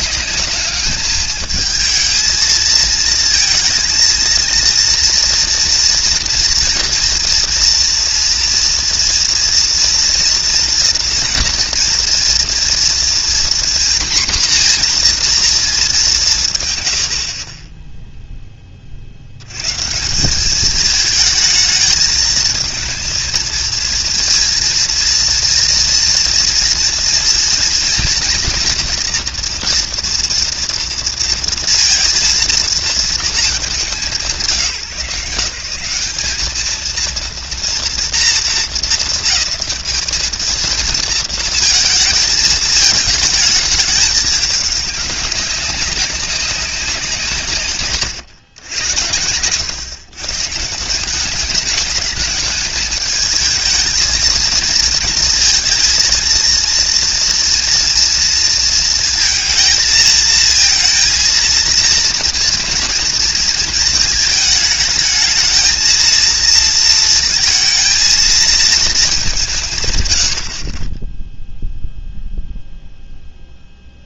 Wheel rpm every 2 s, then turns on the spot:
210, 220, 230, 230, 230, 230, 230, 240, 130, 10, 200, 220, 230, 230, 230, 240, 230, 140, 220, 230, 220, 220, 210, 200, 110, 150, 210, 220, 230, 230, 230, 230, 220, 230, 220, 60, 0.
none